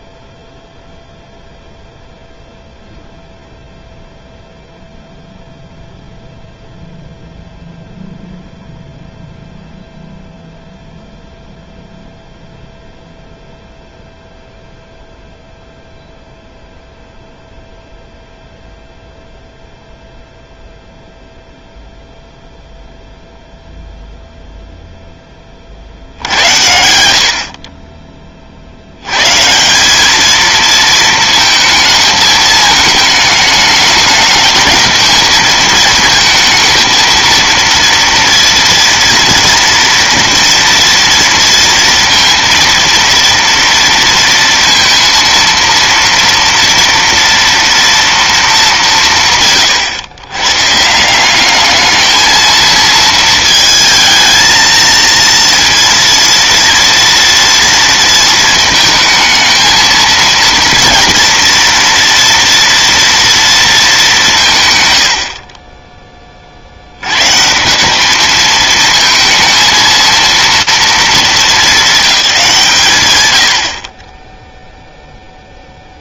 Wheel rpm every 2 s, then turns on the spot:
0, 0, 0, 0, 0, 0, 0, 0, 0, 0, 0, 0, 10, 70, 130, 220, 220, 220, 230, 230, 230, 230, 230, 230, 160, 180, 220, 230, 230, 220, 230, 230, 70, 120, 220, 210, 110, 0.
none